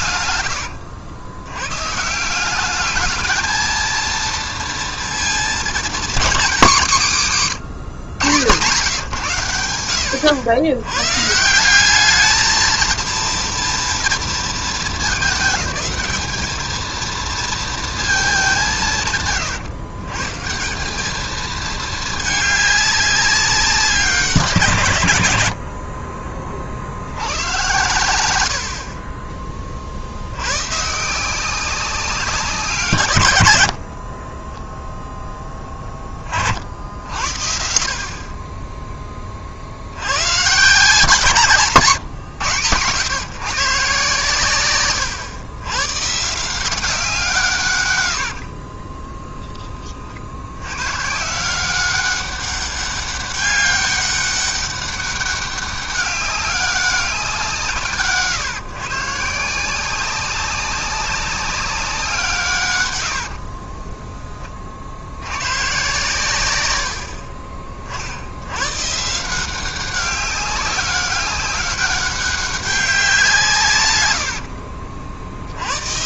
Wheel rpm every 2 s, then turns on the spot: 90, 210, 230, 170, 130, 120, 230, 220, 220, 150, 190, 200, 140, 60, 50, 140, 160, 10, 60, 10, 140, 120, 120, 170, 20, 120, 200, 200, 190, 140, 190, 100, 50, 90, 130, 190, 190, 50.
0-2 48-50